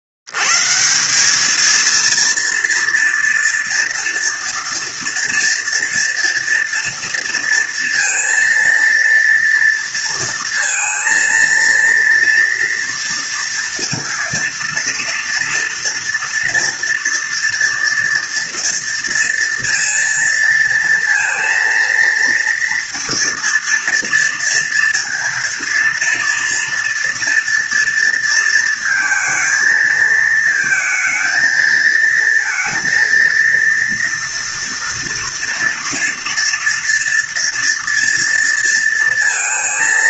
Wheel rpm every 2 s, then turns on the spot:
70, 230, 240, 230, 230, 230, 230, 230, 230, 230, 230, 230, 230, 240, 230, 220, 230, 230, 230, 230.
none